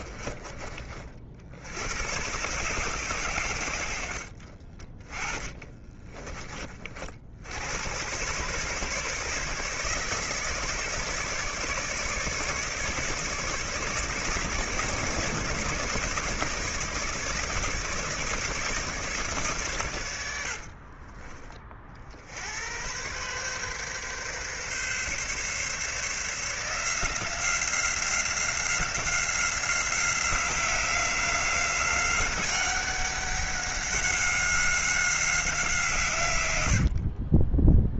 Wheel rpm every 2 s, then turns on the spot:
40, 120, 30, 40, 140, 150, 150, 150, 150, 150, 30, 100, 140, 170, 180, 180, 190, 190, 60.
4-6 20-22 36-38